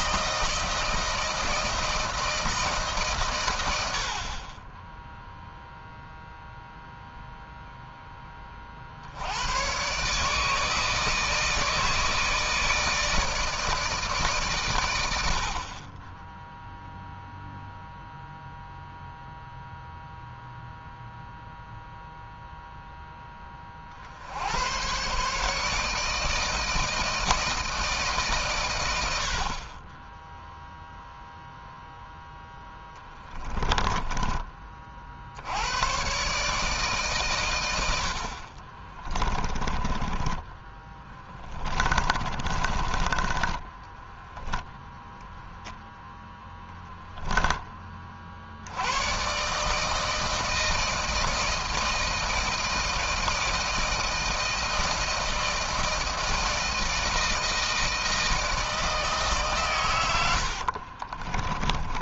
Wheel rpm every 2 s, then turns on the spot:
160, 140, 10, 0, 60, 160, 160, 100, 0, 0, 0, 0, 120, 160, 90, 0, 10, 50, 140, 30, 20, 20, 0, 10, 110, 160, 160, 160, 160, 150, 40.
32-34 38-44 60-62